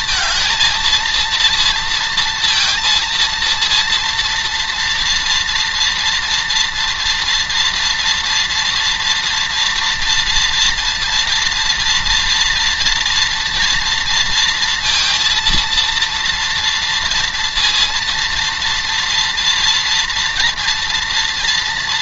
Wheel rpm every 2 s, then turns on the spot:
220, 230, 230, 230, 240, 230, 230, 230, 230, 230, 230.
none